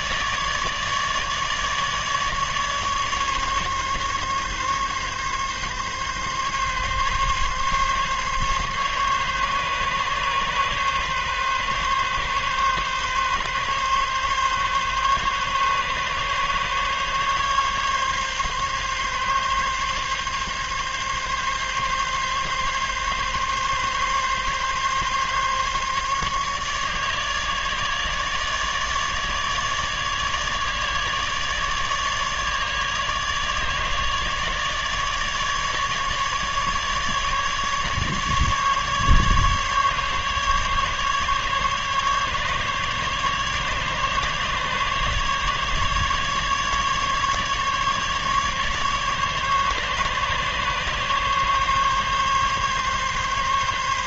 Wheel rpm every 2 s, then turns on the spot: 150, 150, 140, 140, 140, 140, 140, 140, 140, 140, 140, 140, 140, 150, 150, 150, 150, 150, 150, 150, 150, 150, 140, 150, 150, 140, 140.
none